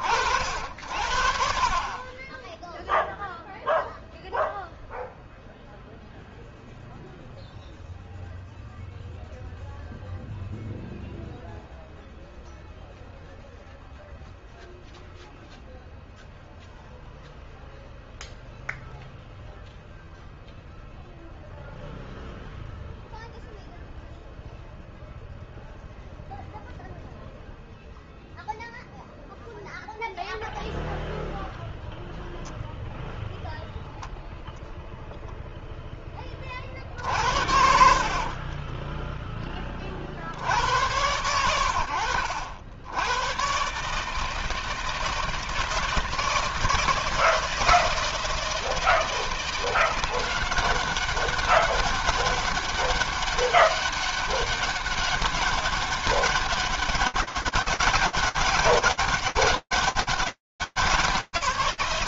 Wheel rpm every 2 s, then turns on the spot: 70, 20, 0, 0, 0, 0, 0, 0, 0, 0, 0, 0, 0, 0, 0, 0, 0, 0, 40, 40, 80, 70, 160, 160, 160, 190, 200, 200, 200, 200, 130.
38-40